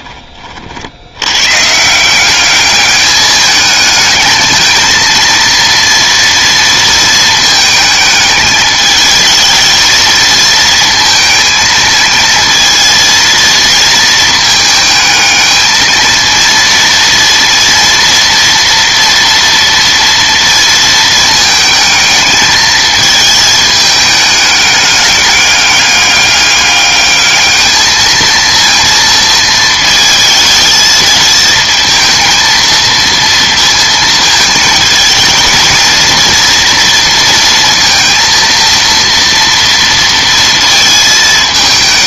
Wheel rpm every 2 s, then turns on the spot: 50, 200, 220, 230, 210, 220, 230, 220, 230, 230, 230, 220, 210, 200, 230, 220, 230, 220, 230, 230, 230.
none